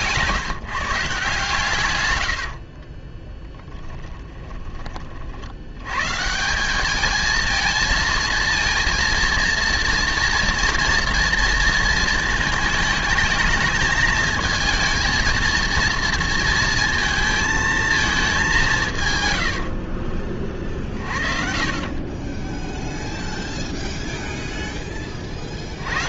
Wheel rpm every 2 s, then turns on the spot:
160, 60, 20, 180, 230, 230, 220, 220, 230, 170, 30, 10, 0.
2-4